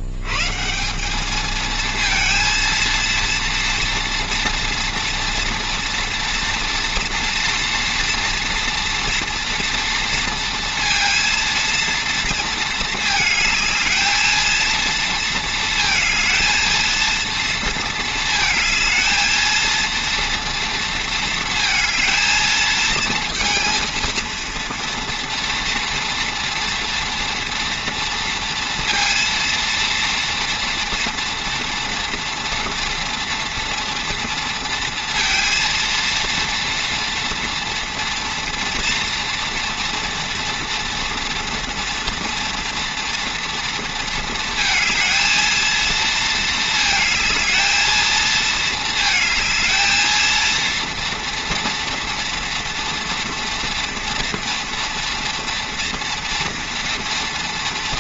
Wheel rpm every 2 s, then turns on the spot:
100, 230, 230, 230, 230, 230, 230, 220, 220, 220, 230, 220, 230, 230, 230, 230, 230, 230, 230, 240, 230, 230, 230, 220, 220, 230, 230, 240, 230.
none